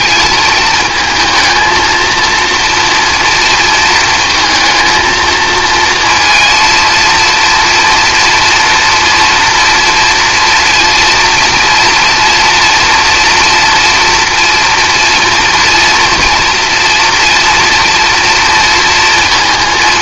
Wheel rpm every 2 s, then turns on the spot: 220, 230, 230, 230, 230, 230, 240, 230, 230, 230.
none